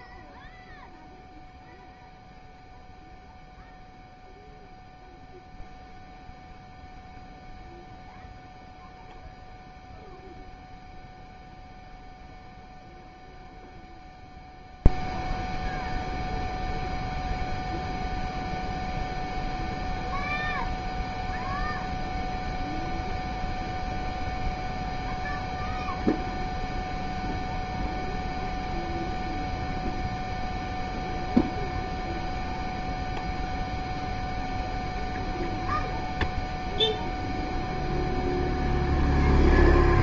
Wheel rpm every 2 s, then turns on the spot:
0, 0, 0, 0, 0, 0, 0, 0, 0, 0, 0, 0, 0, 0, 0, 0, 0, 0, 0, 0.
none